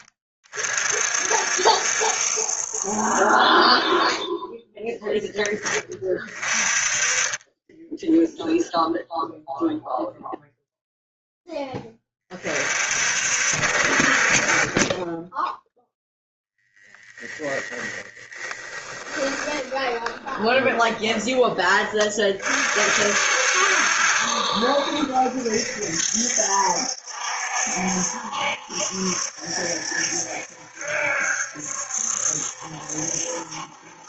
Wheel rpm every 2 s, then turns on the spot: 40, 50, 10, 30, 0, 0, 40, 20, 10, 10, 20, 50, 70, 60, 70, 60, 70.
18-22